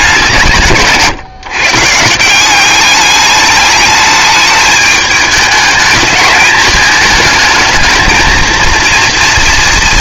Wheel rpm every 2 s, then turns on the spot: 150, 200, 210, 220, 230.
none